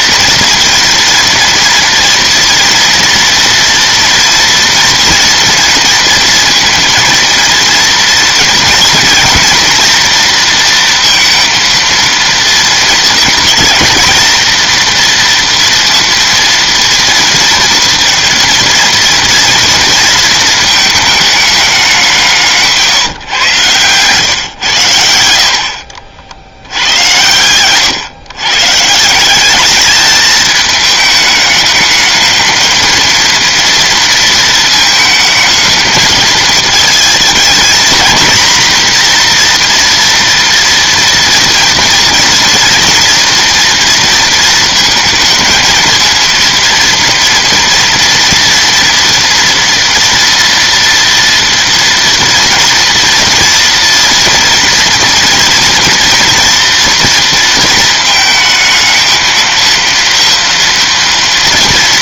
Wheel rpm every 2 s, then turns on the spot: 230, 230, 230, 230, 230, 230, 230, 230, 230, 230, 220, 160, 110, 80, 120, 210, 220, 220, 220, 240, 230, 230, 230, 230, 230, 240, 230, 230, 230, 220, 230.
none